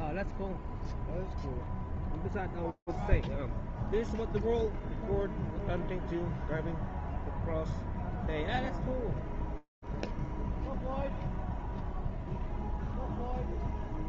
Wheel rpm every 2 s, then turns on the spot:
0, 0, 0, 0, 0, 0, 0.
none